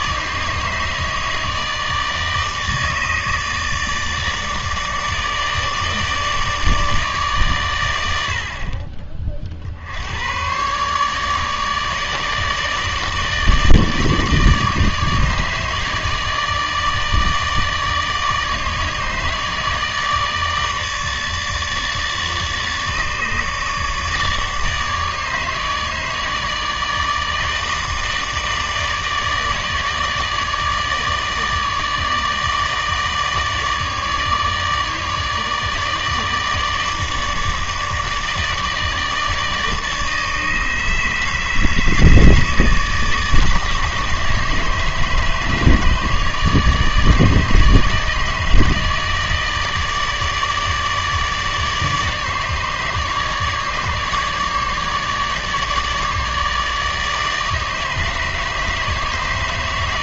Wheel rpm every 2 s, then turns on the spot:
150, 150, 150, 150, 40, 120, 150, 150, 150, 150, 160, 150, 150, 160, 150, 150, 150, 150, 150, 150, 150, 150, 150, 150, 160, 150, 150, 150, 150, 150.
8-10